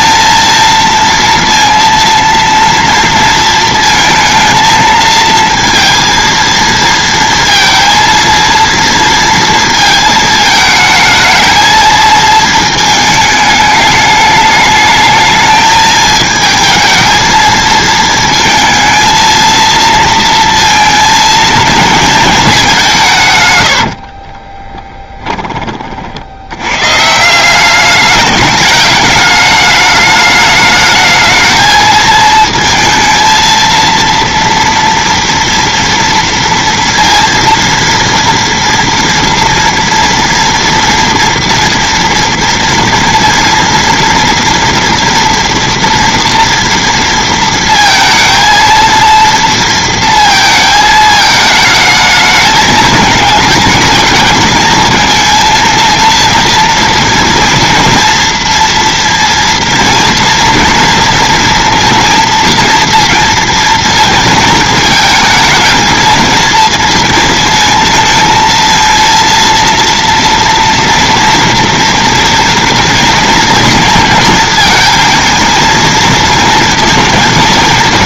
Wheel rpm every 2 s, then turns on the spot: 230, 230, 220, 230, 230, 220, 220, 210, 220, 230, 230, 200, 20, 110, 210, 210, 230, 230, 230, 230, 230, 230, 240, 230, 230, 220, 210, 220, 230, 230, 230, 230, 220, 230, 230, 230, 230, 220, 230.
24-26